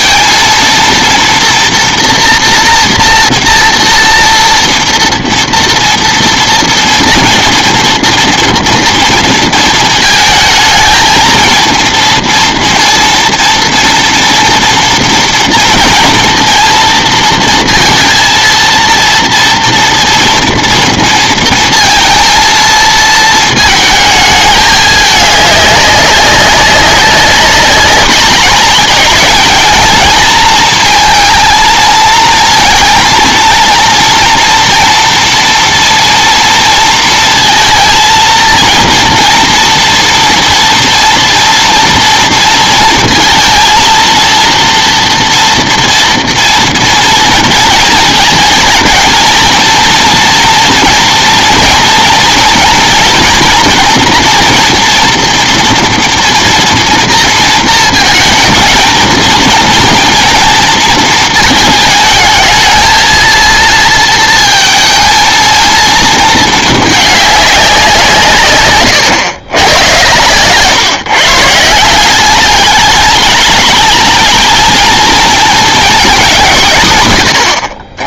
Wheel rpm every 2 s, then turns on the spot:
230, 240, 230, 230, 230, 220, 230, 230, 230, 230, 230, 230, 220, 200, 210, 230, 230, 230, 230, 230, 240, 230, 230, 230, 220, 230, 230, 230, 240, 220, 230, 220, 230, 220, 130, 130, 200, 230, 190.
none